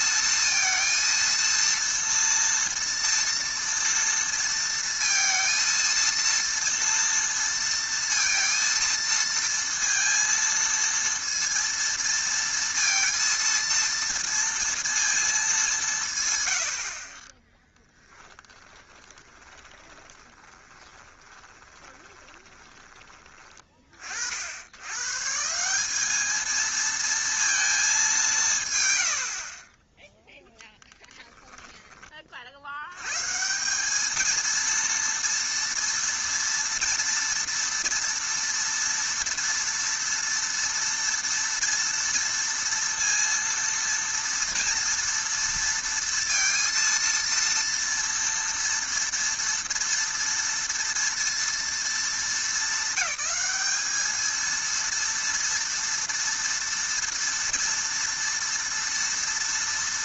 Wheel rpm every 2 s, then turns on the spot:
230, 230, 230, 230, 230, 230, 230, 230, 80, 20, 20, 20, 100, 220, 140, 0, 80, 230, 230, 230, 230, 230, 230, 230, 230, 230, 210, 230, 230, 230.
18-22